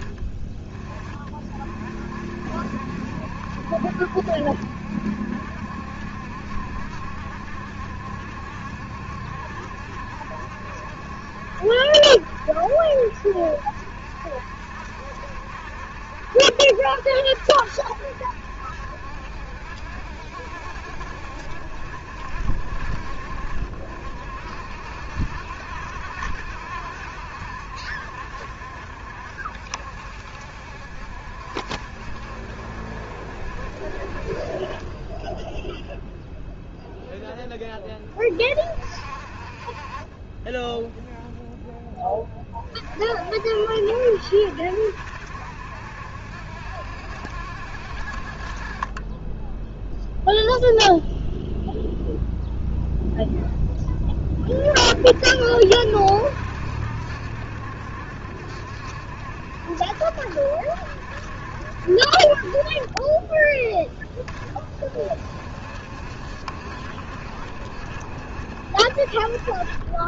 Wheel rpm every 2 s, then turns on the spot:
30, 70, 70, 70, 70, 70, 70, 70, 70, 70, 60, 70, 60, 60, 60, 60, 60, 30, 0, 30, 10, 40, 70, 70, 30, 0, 0, 40, 70, 70, 70, 30, 30, 50, 30.
none